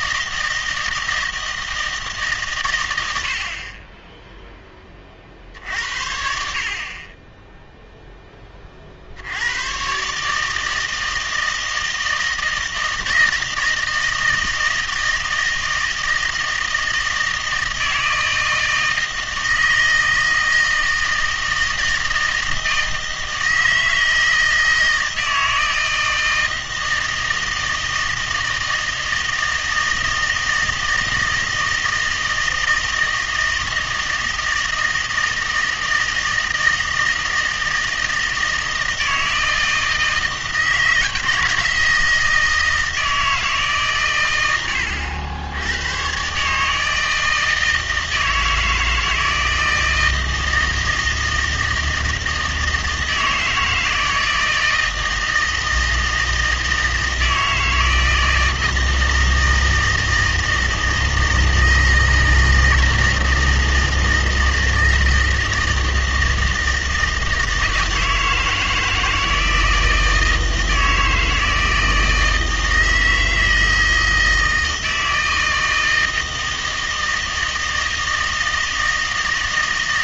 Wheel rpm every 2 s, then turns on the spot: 160, 110, 20, 50, 30, 160, 160, 160, 160, 160, 160, 160, 160, 160, 160, 160, 160, 160, 160, 160, 160, 160, 100, 150, 160, 160, 160, 160, 160, 160, 160, 160, 160, 160, 160, 160, 160, 160, 160, 160.
none